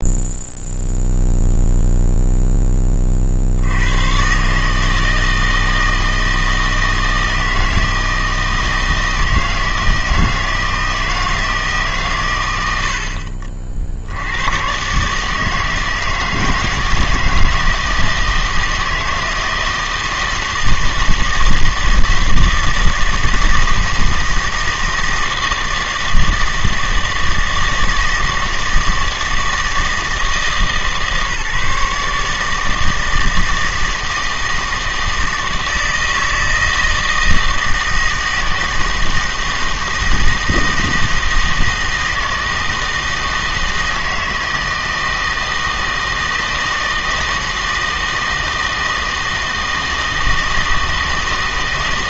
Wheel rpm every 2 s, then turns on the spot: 0, 10, 150, 160, 160, 160, 80, 120, 160, 160, 160, 160, 160, 160, 160, 160, 160, 160, 160, 160, 160, 160, 160, 160, 160, 160.
none